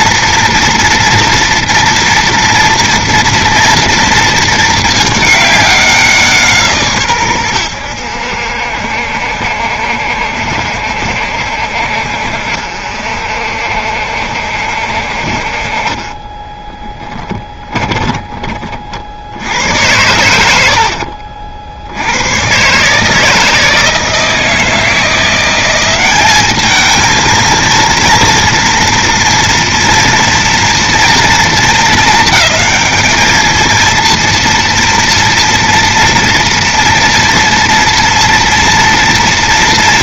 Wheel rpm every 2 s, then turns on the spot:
230, 230, 220, 160, 80, 70, 60, 70, 20, 20, 110, 100, 160, 200, 230, 230, 220, 230, 230, 230.
16-18